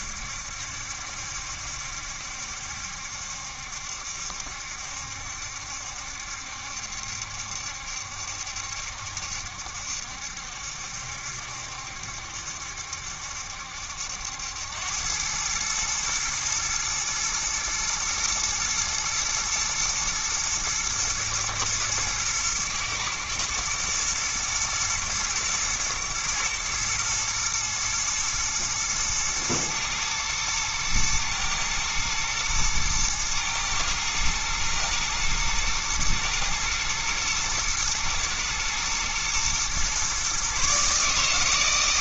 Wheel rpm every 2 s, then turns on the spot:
70, 70, 70, 70, 70, 70, 70, 80, 110, 120, 110, 110, 120, 110, 120, 110, 110, 110, 110, 110, 130.
none